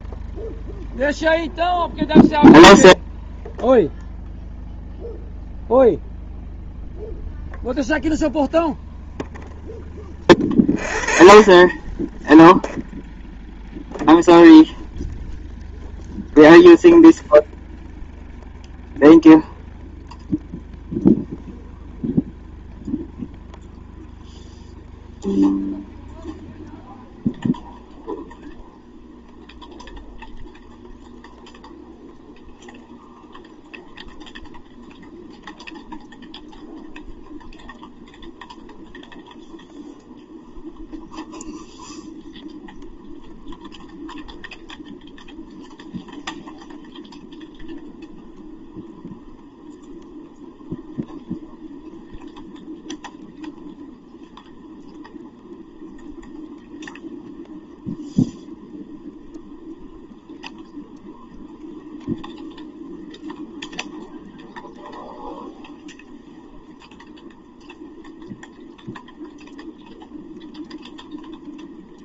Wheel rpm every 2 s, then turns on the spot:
0, 0, 0, 0, 0, 40, 0, 0, 0, 0, 0, 0, 0, 0, 0, 0, 0, 0, 0, 0, 0, 0, 0, 0, 0, 0, 0, 0, 0, 0, 0, 0, 0, 0, 0, 0.
none